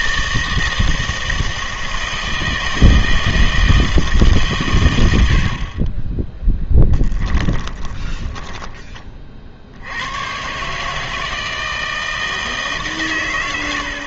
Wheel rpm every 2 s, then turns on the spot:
160, 160, 120, 10, 20, 150, 150.
6-8